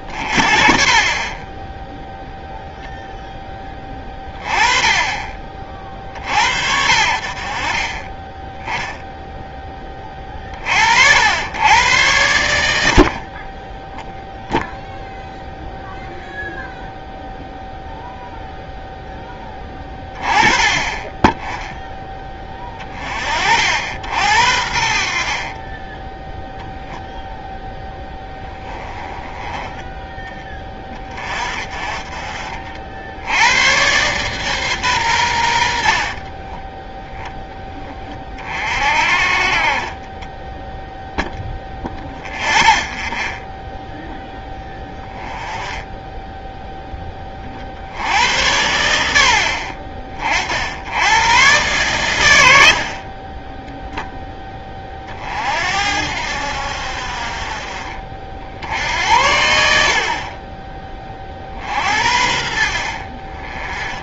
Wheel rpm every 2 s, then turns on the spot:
30, 0, 20, 50, 20, 50, 80, 0, 0, 0, 10, 30, 60, 0, 10, 20, 60, 120, 10, 50, 0, 0, 10, 10, 90, 80, 60, 30, 70, 70, 30, 50.
24-26